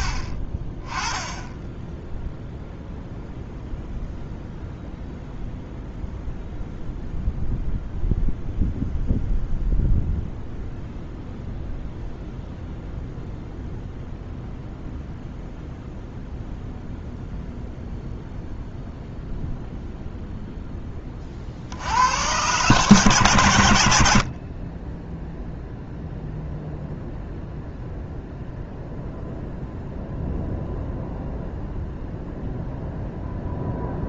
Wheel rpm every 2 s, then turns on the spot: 20, 0, 0, 0, 0, 0, 0, 0, 0, 0, 10, 130, 30, 0, 0, 0, 0.
none